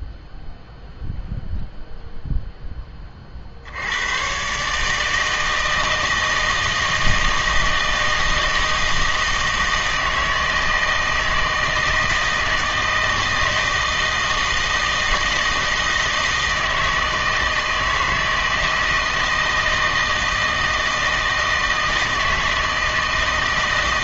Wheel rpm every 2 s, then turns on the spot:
0, 10, 140, 160, 160, 160, 160, 160, 160, 160, 160, 160.
none